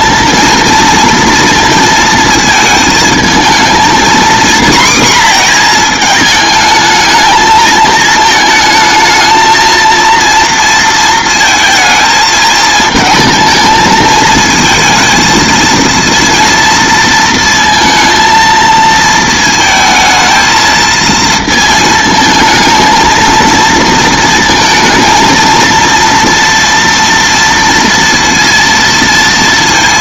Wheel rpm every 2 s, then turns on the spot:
230, 230, 240, 220, 220, 230, 220, 230, 230, 230, 220, 220, 230, 230, 230.
none